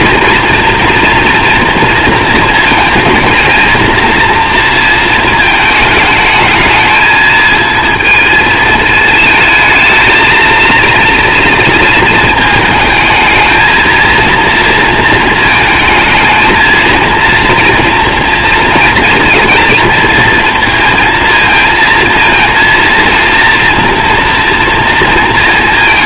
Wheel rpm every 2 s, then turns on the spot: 230, 230, 230, 210, 220, 230, 220, 230, 220, 230, 230, 230, 230.
none